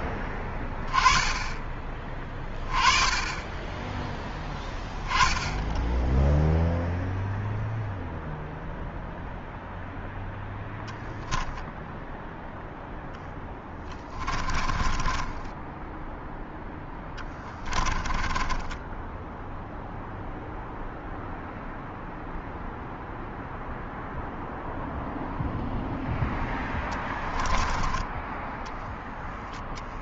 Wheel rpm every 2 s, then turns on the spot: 20, 20, 10, 0, 0, 0, 10, 20, 10, 10, 0, 0, 0, 10, 0.
12-18 26-28